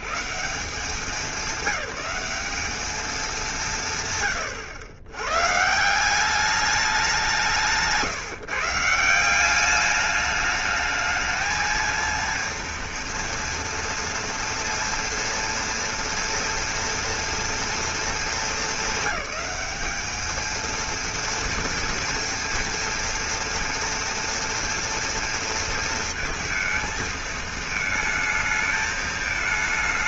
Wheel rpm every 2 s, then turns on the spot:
120, 200, 130, 180, 160, 210, 230, 230, 230, 220, 210, 230, 230, 230, 220.
none